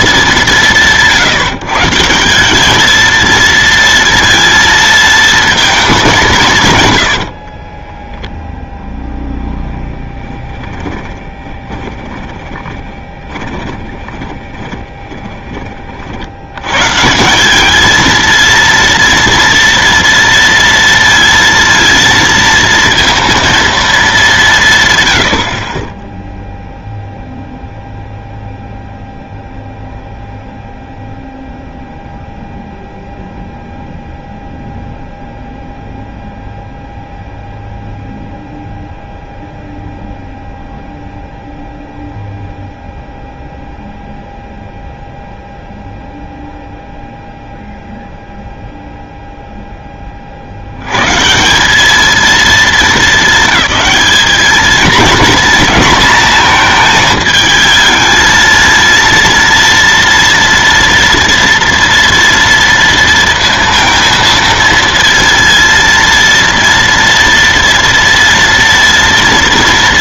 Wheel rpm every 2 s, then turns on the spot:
180, 200, 230, 150, 0, 20, 10, 30, 100, 230, 230, 230, 180, 0, 0, 0, 0, 0, 0, 0, 0, 0, 0, 0, 0, 70, 220, 220, 230, 230, 230, 230, 230, 230, 230.
10-16